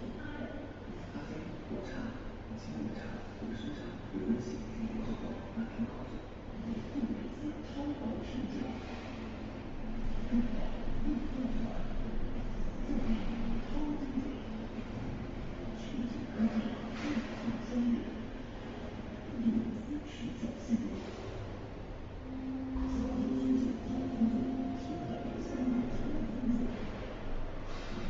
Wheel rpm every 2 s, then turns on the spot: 0, 0, 0, 0, 0, 0, 0, 0, 0, 0, 0, 0, 0, 0.
none